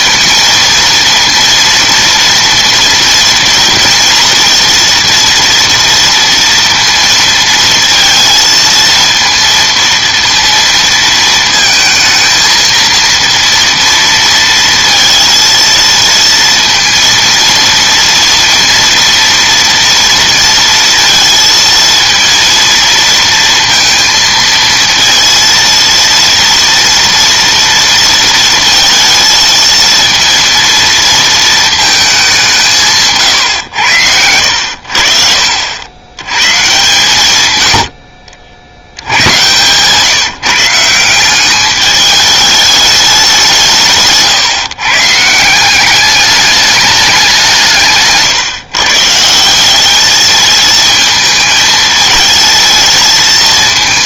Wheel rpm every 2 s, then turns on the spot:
230, 230, 230, 230, 230, 230, 230, 230, 230, 230, 230, 230, 230, 230, 220, 230, 160, 80, 130, 70, 170, 210, 140, 210, 140, 220, 220.
none